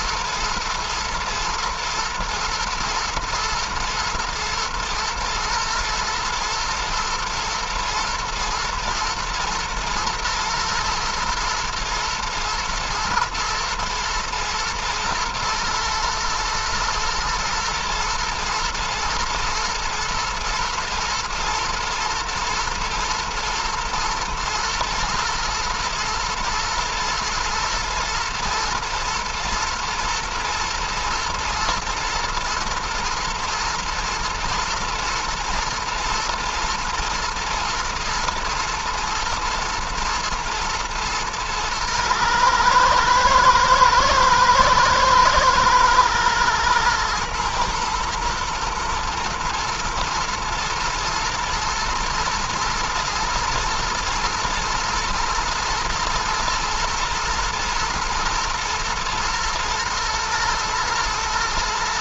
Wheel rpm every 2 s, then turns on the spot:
110, 110, 110, 110, 110, 110, 120, 120, 120, 120, 120, 120, 110, 110, 110, 120, 120, 120, 110, 120, 120, 110, 120, 110, 110, 120, 110, 120, 120, 110, 120.
none